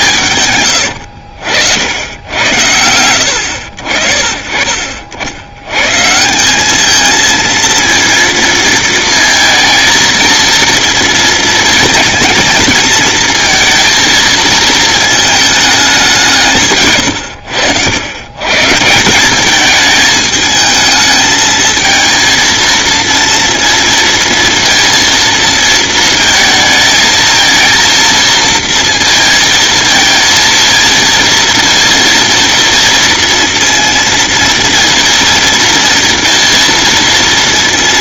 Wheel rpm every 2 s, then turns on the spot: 110, 100, 50, 210, 230, 230, 230, 220, 130, 160, 220, 230, 230, 220, 230, 230, 230, 230, 230.
0-2